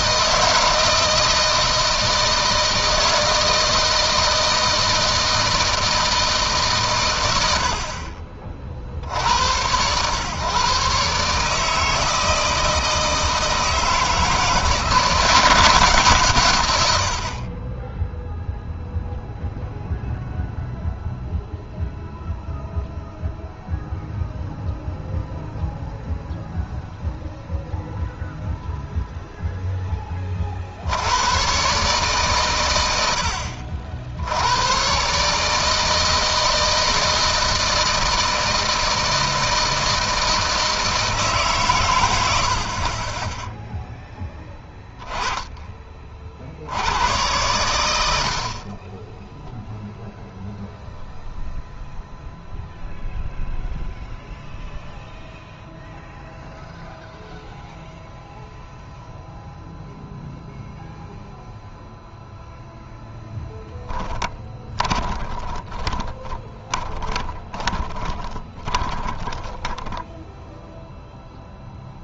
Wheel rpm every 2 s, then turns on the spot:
160, 160, 160, 140, 40, 130, 160, 160, 120, 0, 0, 0, 0, 0, 0, 50, 100, 100, 160, 160, 160, 60, 10, 70, 40, 0, 0, 0, 0, 0, 0, 0, 10, 20, 20, 0.
48-50 64-70